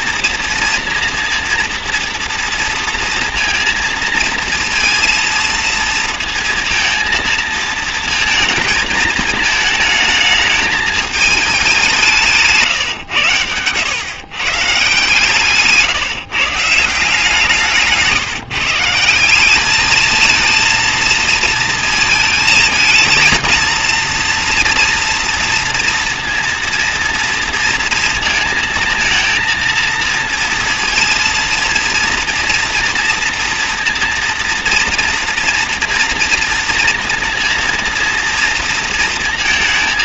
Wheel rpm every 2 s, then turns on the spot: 230, 230, 230, 230, 220, 220, 150, 130, 160, 150, 220, 220, 230, 230, 230, 230, 230, 230, 230, 230.
none